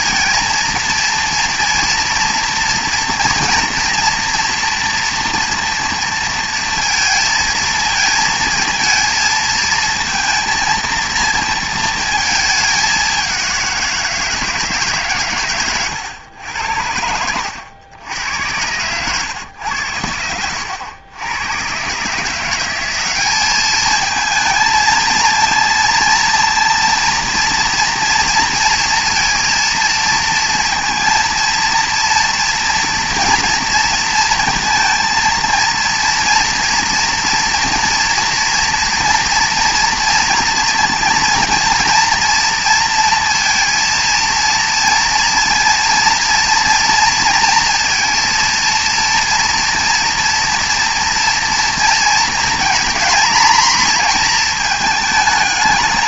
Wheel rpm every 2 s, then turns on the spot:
230, 230, 240, 230, 230, 230, 210, 160, 80, 100, 80, 180, 230, 230, 230, 230, 230, 230, 240, 230, 230, 230, 230, 230, 230, 240, 230, 220.
none